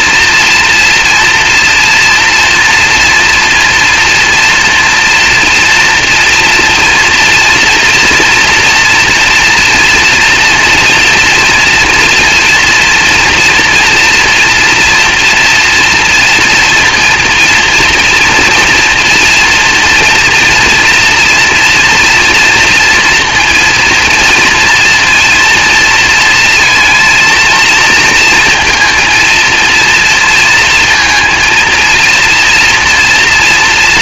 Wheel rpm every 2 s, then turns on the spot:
230, 230, 230, 230, 230, 230, 240, 230, 230, 230, 230, 230, 230, 230, 230, 230, 230.
none